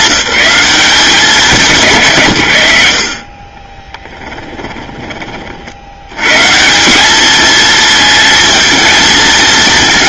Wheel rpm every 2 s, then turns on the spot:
180, 60, 20, 200, 220.
none